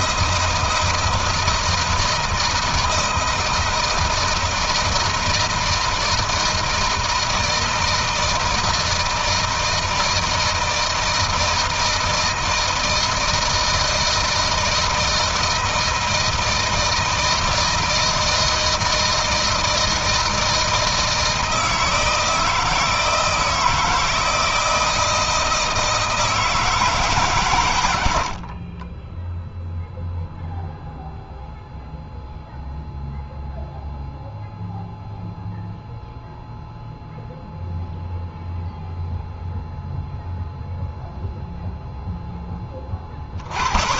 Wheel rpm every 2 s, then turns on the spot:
160, 160, 160, 160, 160, 160, 160, 160, 160, 160, 160, 160, 160, 160, 30, 0, 0, 0, 0, 0, 0, 30.
none